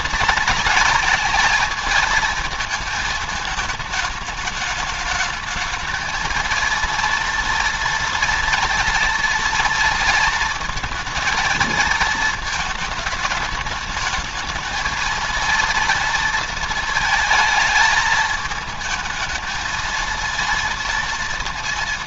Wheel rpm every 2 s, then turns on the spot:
230, 220, 220, 230, 230, 220, 220, 230, 230, 220, 230.
none